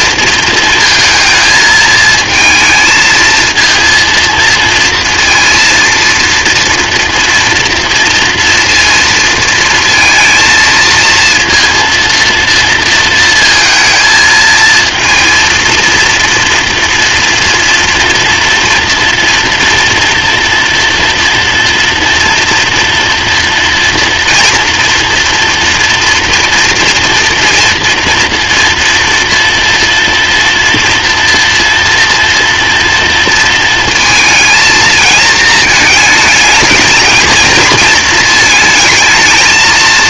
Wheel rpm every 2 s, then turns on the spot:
230, 220, 230, 230, 230, 230, 230, 230, 230, 230, 240, 230, 230, 230, 230, 230, 230, 230, 220, 220.
none